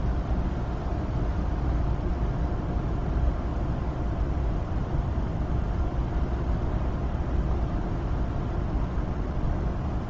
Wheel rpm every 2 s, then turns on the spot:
0, 0, 0, 0, 0.
none